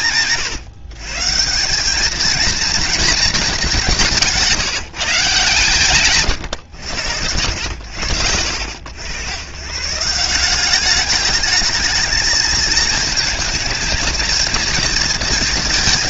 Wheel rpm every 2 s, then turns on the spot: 120, 230, 160, 90, 90, 210, 220, 230.
none